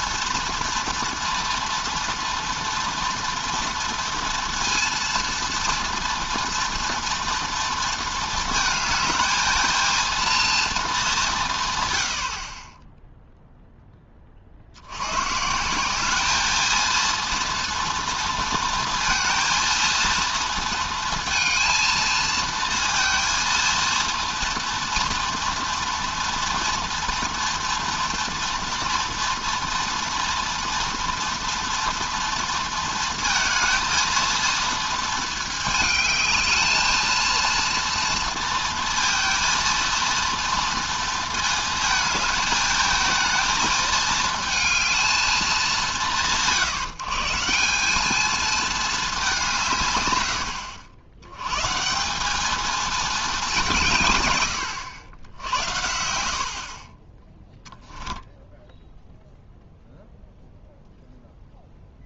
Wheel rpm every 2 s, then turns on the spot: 230, 230, 230, 230, 220, 230, 30, 80, 220, 230, 230, 230, 240, 230, 230, 230, 230, 230, 220, 230, 230, 220, 220, 140, 220, 80, 210, 90, 50, 10, 0.
58-60